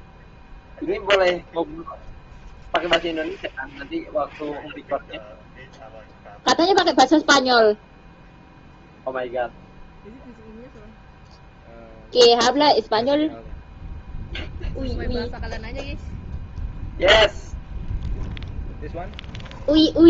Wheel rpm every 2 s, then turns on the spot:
0, 0, 0, 0, 0, 0, 0, 0, 0, 0.
none